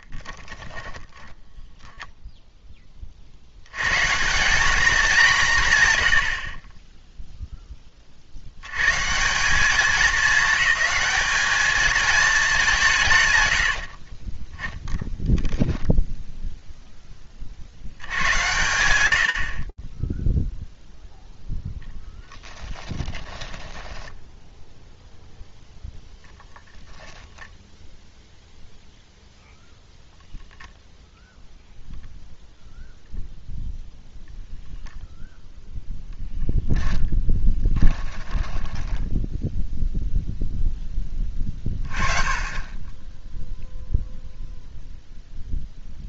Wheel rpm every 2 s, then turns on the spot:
10, 20, 210, 0, 140, 210, 150, 0, 20, 80, 0, 20, 0, 0, 0, 0, 0, 0, 10, 0, 20, 10, 0.
0-2 22-24